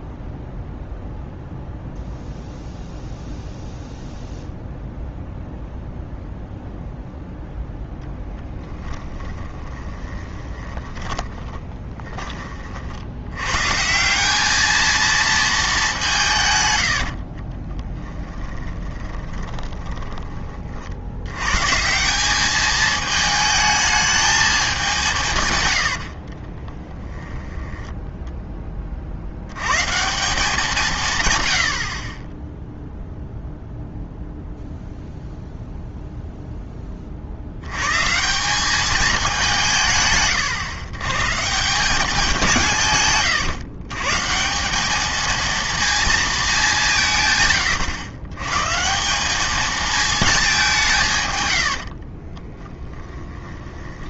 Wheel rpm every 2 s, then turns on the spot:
0, 0, 0, 0, 20, 20, 40, 210, 100, 20, 50, 210, 190, 20, 20, 170, 0, 0, 10, 200, 120, 160, 190, 190, 140, 190, 20.
8-12 18-20 26-28 52-54